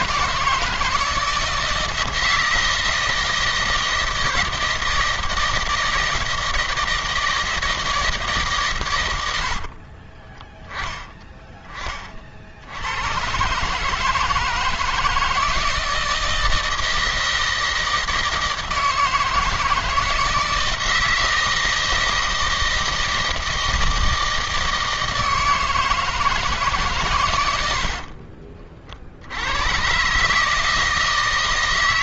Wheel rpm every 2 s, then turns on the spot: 160, 170, 160, 160, 140, 10, 50, 160, 160, 160, 160, 160, 160, 160, 60, 150.
none